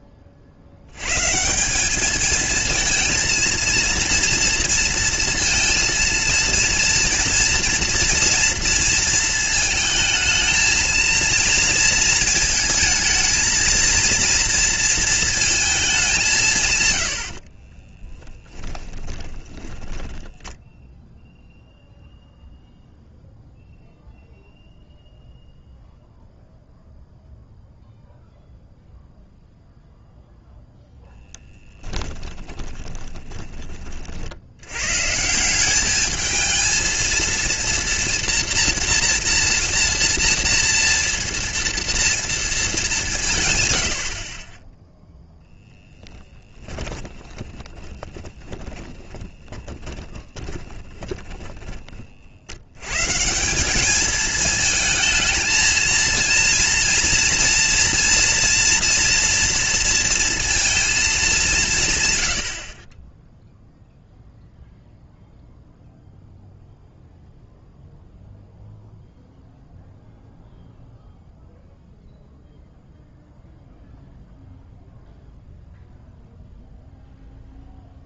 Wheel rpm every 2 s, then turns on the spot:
50, 220, 230, 230, 230, 220, 220, 240, 170, 10, 10, 0, 0, 0, 0, 0, 20, 90, 220, 240, 230, 230, 30, 10, 20, 20, 70, 220, 230, 230, 230, 80, 0, 0, 0, 0, 0, 0, 0.
18-22 32-34 46-52